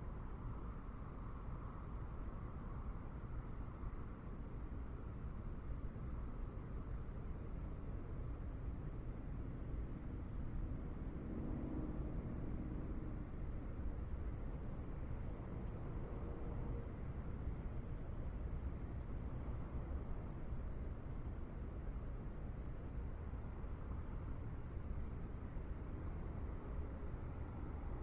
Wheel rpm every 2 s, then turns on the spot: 0, 0, 0, 0, 0, 0, 0, 0, 0, 0, 0, 0, 0, 0.
none